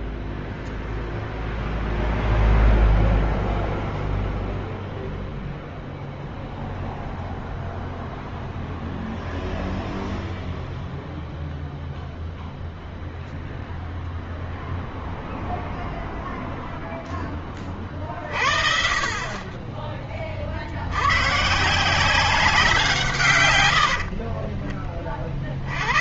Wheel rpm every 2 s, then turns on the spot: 0, 0, 0, 0, 0, 0, 0, 0, 10, 30, 80, 170, 40.
none